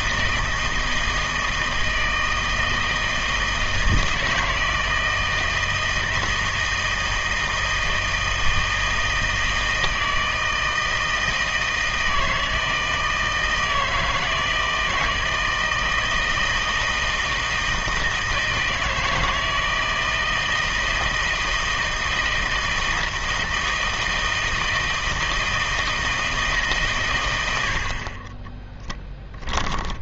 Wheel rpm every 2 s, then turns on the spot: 160, 160, 160, 160, 160, 160, 160, 160, 160, 160, 160, 160, 160, 150, 10.
28-30